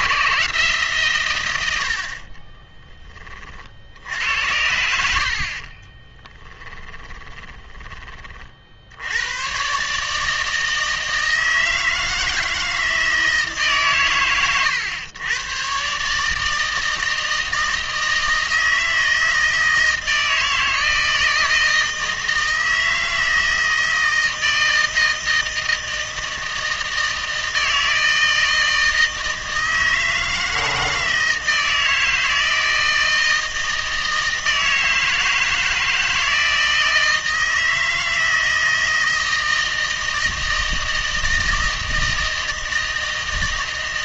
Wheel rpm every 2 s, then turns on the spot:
140, 30, 80, 20, 60, 160, 160, 110, 160, 160, 160, 160, 160, 160, 160, 160, 160, 160, 160, 160, 160, 160.
2-8